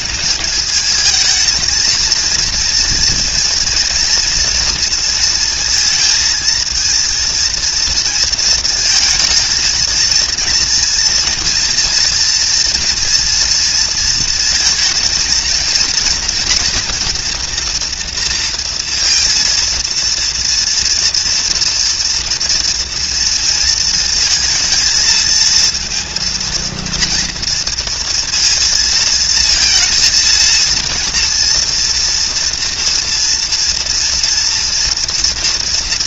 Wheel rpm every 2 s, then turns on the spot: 210, 230, 230, 230, 220, 240, 240, 230, 230, 230, 230, 230, 230, 230, 230, 230, 230, 240.
none